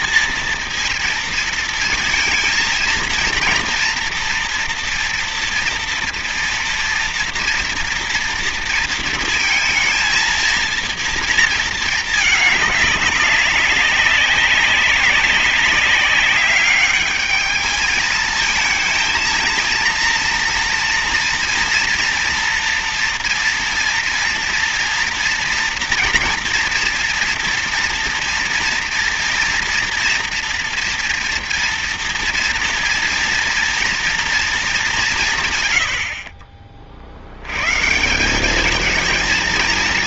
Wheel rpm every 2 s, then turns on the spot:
230, 230, 230, 230, 230, 230, 200, 190, 200, 220, 230, 230, 230, 230, 230, 240, 230, 210, 50, 210.
none